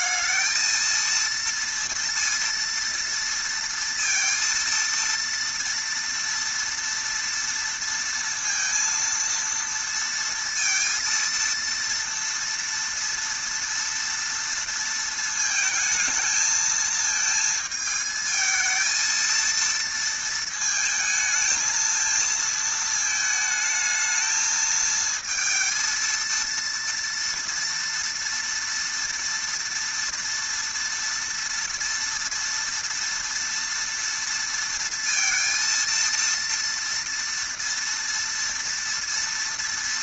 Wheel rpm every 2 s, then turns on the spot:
220, 230, 230, 230, 230, 230, 230, 230, 220, 220, 220, 220, 220, 230, 230, 230, 240, 230, 230, 230.
none